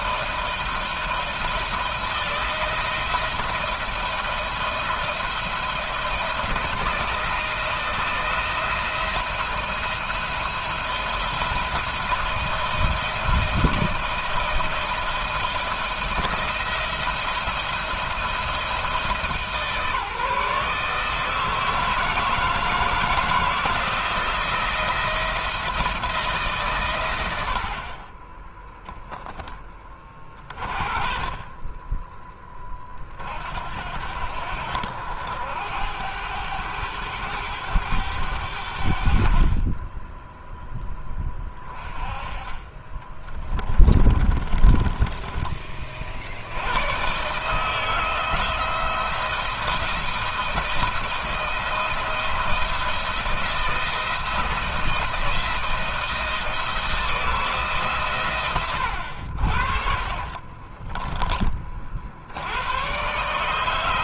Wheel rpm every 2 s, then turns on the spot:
170, 170, 170, 170, 170, 170, 170, 160, 170, 160, 150, 160, 170, 120, 20, 30, 30, 80, 100, 70, 10, 20, 20, 110, 170, 170, 170, 170, 170, 90, 20, 120.
28-30 42-44 60-62